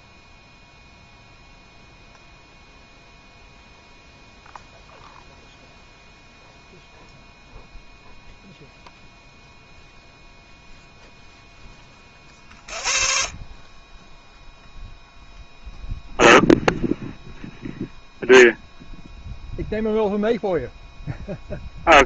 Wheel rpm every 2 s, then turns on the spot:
0, 0, 0, 0, 0, 0, 40, 0, 0, 0, 0.
none